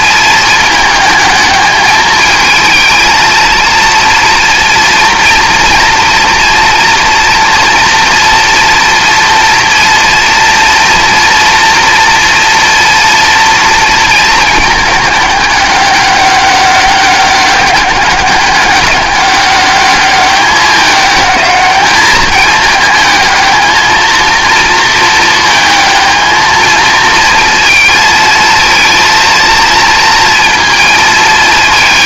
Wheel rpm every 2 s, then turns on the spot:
220, 220, 240, 230, 240, 230, 230, 220, 200, 200, 200, 210, 230, 220, 230, 230.
none